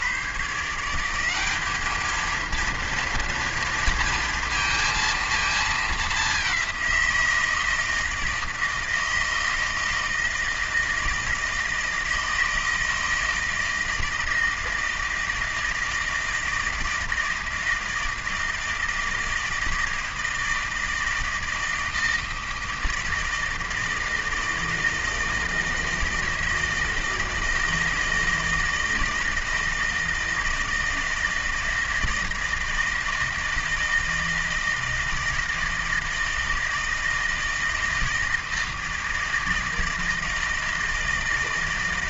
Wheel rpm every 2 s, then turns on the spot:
160, 230, 230, 190, 160, 160, 160, 160, 160, 160, 160, 160, 160, 160, 160, 160, 160, 160, 160, 160, 160.
none